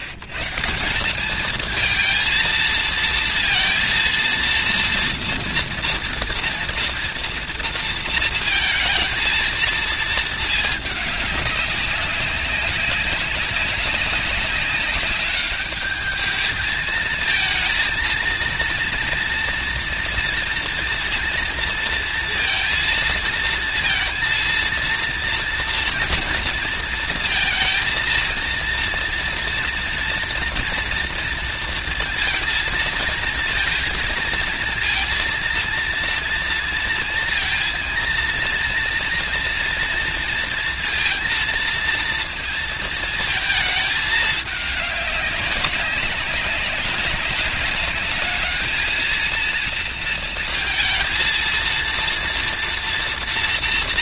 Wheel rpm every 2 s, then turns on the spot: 110, 230, 230, 230, 230, 220, 190, 190, 220, 230, 230, 230, 230, 230, 230, 230, 230, 230, 230, 230, 230, 230, 210, 190, 210, 230, 230.
none